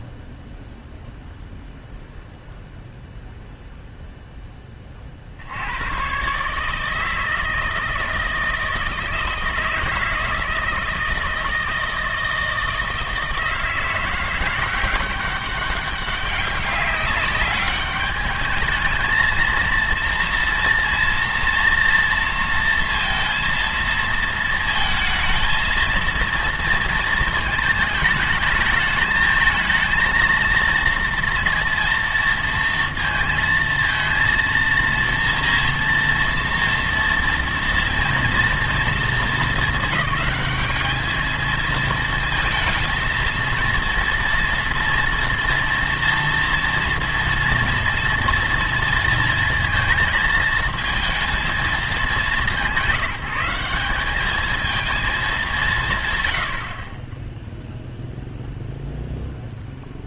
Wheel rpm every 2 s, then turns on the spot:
0, 0, 20, 150, 160, 160, 160, 180, 200, 220, 230, 230, 230, 230, 210, 230, 230, 230, 230, 230, 210, 220, 230, 240, 230, 220, 180, 220, 60, 0.
none